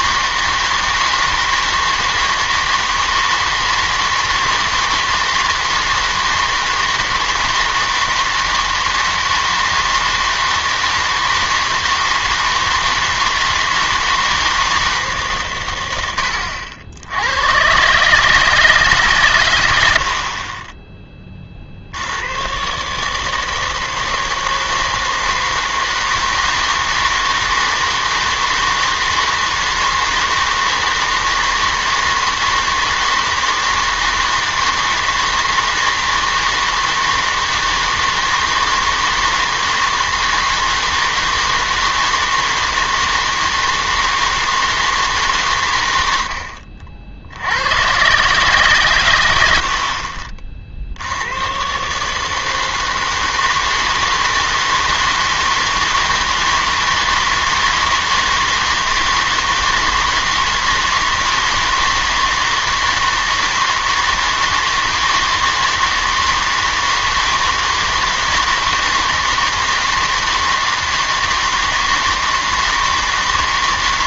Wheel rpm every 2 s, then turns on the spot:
160, 160, 160, 160, 160, 160, 160, 160, 80, 150, 20, 130, 160, 160, 160, 160, 160, 160, 160, 160, 160, 160, 160, 60, 130, 60, 160, 160, 160, 160, 160, 160, 160, 160, 160, 160, 160.
none